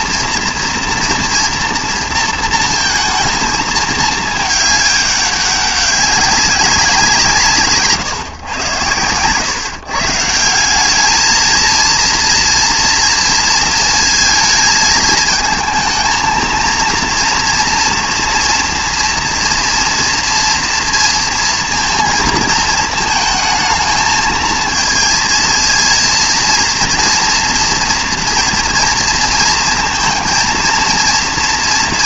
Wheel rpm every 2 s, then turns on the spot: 230, 230, 210, 180, 110, 190, 230, 220, 230, 230, 230, 220, 220, 240, 230, 220.
none